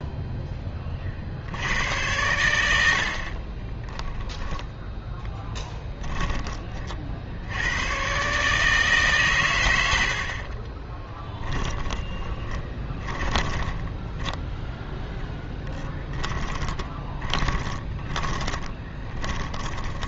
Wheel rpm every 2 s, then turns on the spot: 10, 90, 10, 30, 150, 40, 20, 10, 20, 20.
10-14 16-20